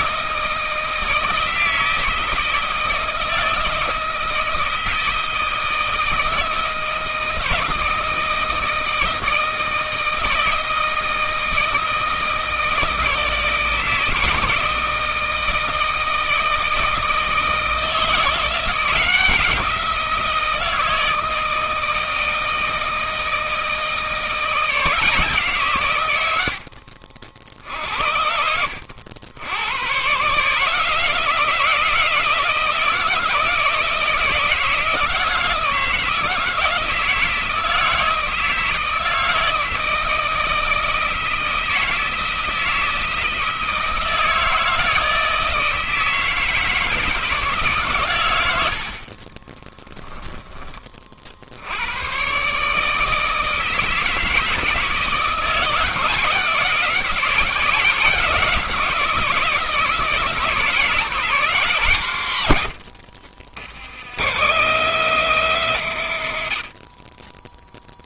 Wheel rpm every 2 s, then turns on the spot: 160, 160, 160, 160, 160, 160, 160, 170, 160, 170, 160, 160, 170, 70, 70, 150, 170, 170, 170, 160, 160, 160, 160, 160, 80, 20, 130, 160, 170, 170, 170, 100, 140, 80.
26-28 50-52